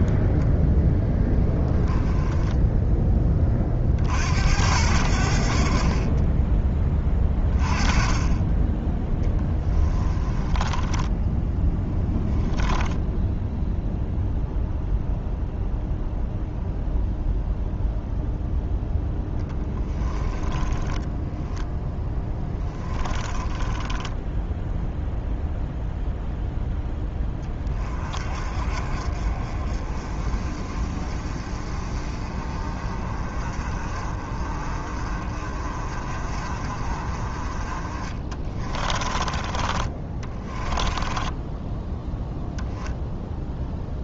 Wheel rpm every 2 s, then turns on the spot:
10, 10, 80, 20, 10, 10, 10, 0, 0, 0, 20, 10, 0, 10, 40, 40, 30, 40, 30, 30, 20, 0.
10-12 20-24 38-42